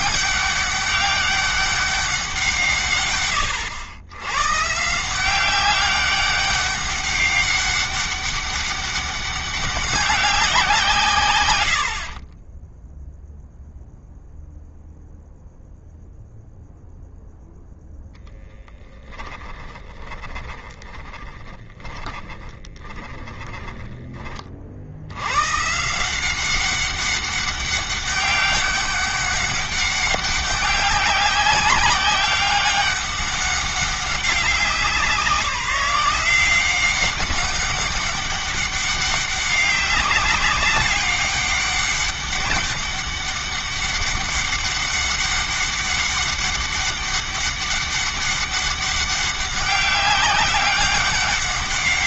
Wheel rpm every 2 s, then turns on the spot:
200, 150, 160, 200, 200, 170, 10, 0, 0, 10, 20, 30, 80, 200, 200, 190, 200, 170, 190, 200, 190, 200, 200, 200, 190, 200.
12-14 18-24